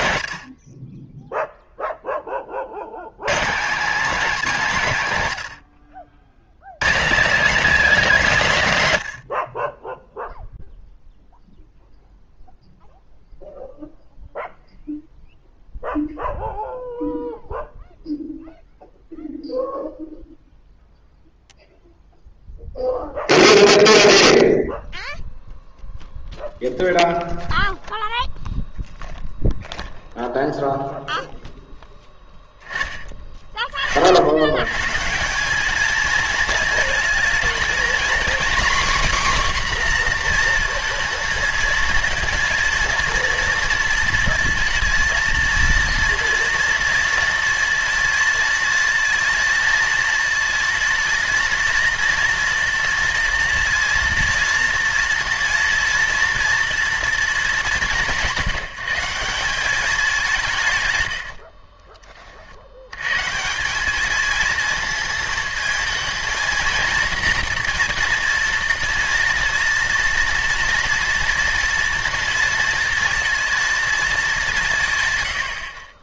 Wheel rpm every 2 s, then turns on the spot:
30, 90, 200, 150, 160, 0, 0, 0, 0, 0, 0, 0, 0, 0, 0, 0, 20, 130, 220, 270, 230, 230, 230, 230, 230, 230, 230, 230, 240, 170, 120, 90, 220, 230, 230, 230, 230, 140.
none